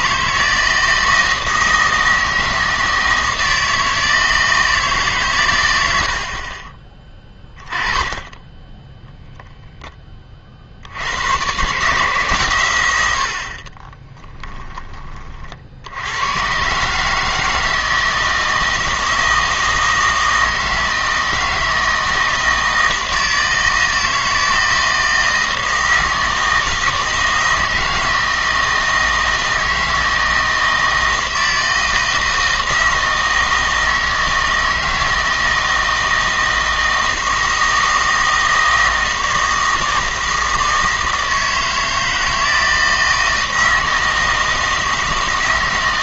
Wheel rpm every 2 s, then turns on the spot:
160, 160, 160, 30, 10, 60, 100, 10, 130, 160, 160, 160, 160, 160, 160, 160, 160, 160, 160, 160, 160, 160, 160.
none